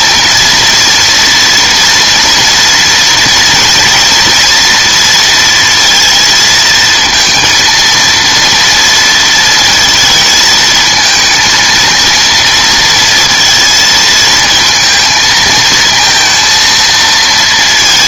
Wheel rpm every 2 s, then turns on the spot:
230, 230, 230, 230, 230, 220, 230, 220, 230.
none